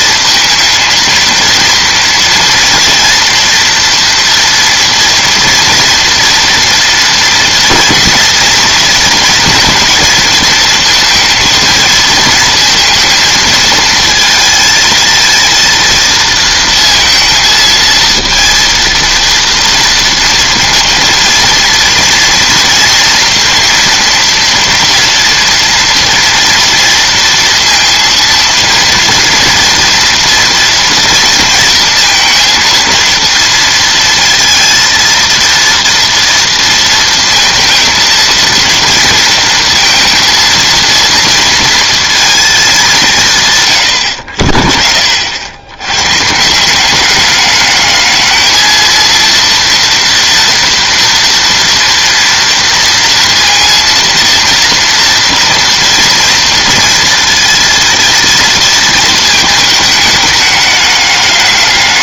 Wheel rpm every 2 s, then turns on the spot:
230, 230, 230, 230, 230, 230, 220, 220, 230, 230, 230, 240, 230, 230, 230, 230, 230, 230, 230, 230, 230, 210, 60, 180, 220, 230, 230, 230, 230, 230, 210.
none